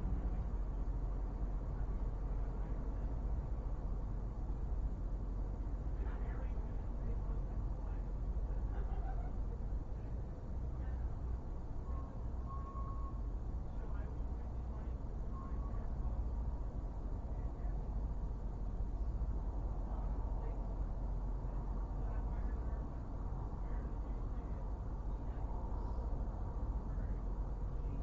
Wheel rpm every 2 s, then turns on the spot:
0, 0, 0, 0, 0, 0, 0, 0, 0, 0, 0, 0, 0, 0.
none